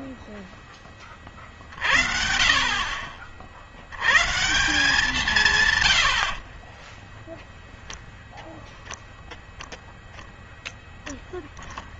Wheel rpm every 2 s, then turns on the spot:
20, 40, 160, 30, 0, 0.
6-8